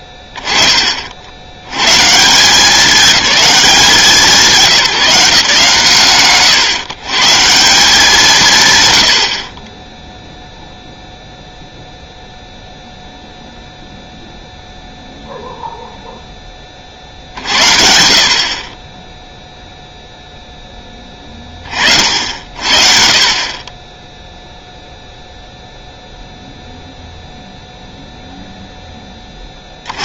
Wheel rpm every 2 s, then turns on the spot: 10, 200, 180, 120, 150, 0, 0, 0, 20, 40, 10, 60, 0, 0, 0.
none